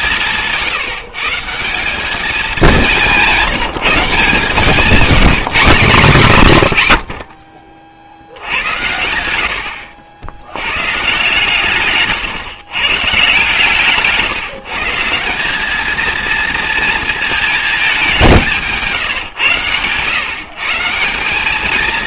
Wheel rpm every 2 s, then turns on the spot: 160, 200, 170, 130, 90, 110, 130, 150, 230, 160, 160.
none